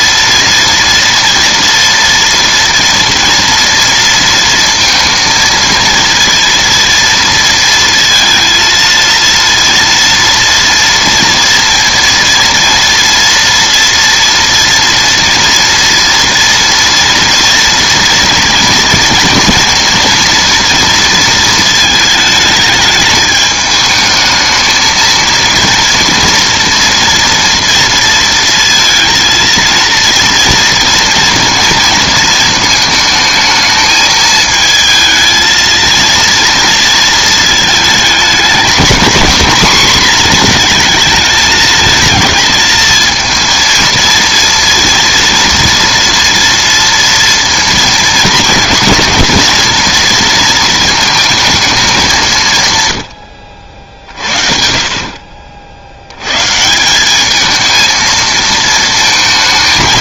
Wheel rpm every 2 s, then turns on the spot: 230, 230, 230, 230, 230, 230, 230, 230, 230, 230, 230, 220, 220, 230, 230, 230, 220, 220, 230, 220, 230, 220, 230, 230, 230, 230, 130, 50, 140, 220.
none